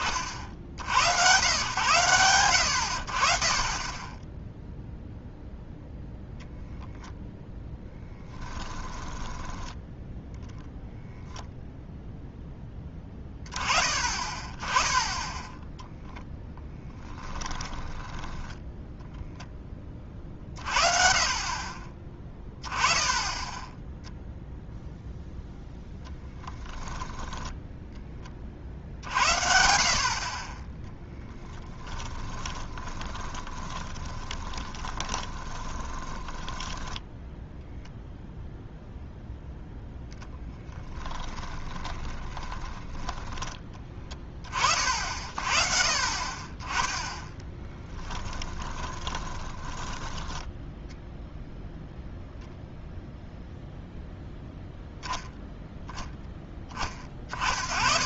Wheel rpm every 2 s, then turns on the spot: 60, 100, 0, 0, 10, 0, 10, 20, 0, 10, 40, 10, 0, 10, 50, 10, 20, 20, 10, 0, 10, 20, 40, 20, 10, 0, 0, 0, 10.
8-10 18-20 32-38 40-44 48-50